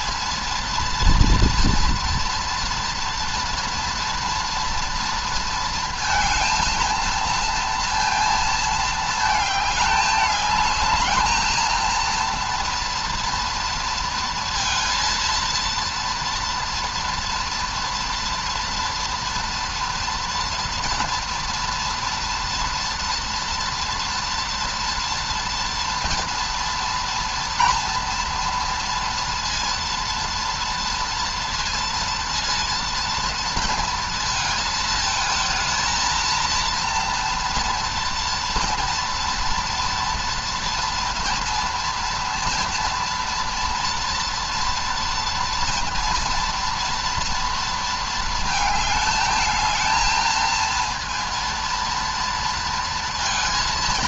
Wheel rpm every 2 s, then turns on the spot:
230, 230, 230, 230, 230, 210, 230, 230, 230, 230, 230, 230, 240, 240, 230, 230, 230, 220, 230, 230, 230, 230, 230, 230, 220, 230, 230.
none